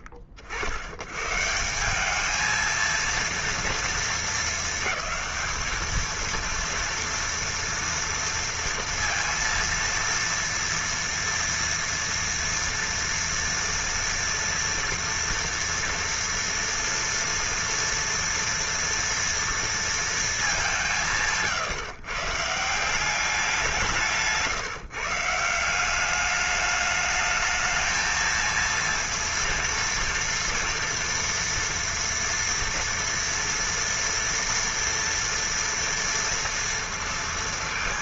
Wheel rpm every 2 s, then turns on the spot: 50, 220, 220, 230, 230, 230, 230, 230, 230, 230, 190, 160, 150, 210, 230, 230, 230, 230, 230.
none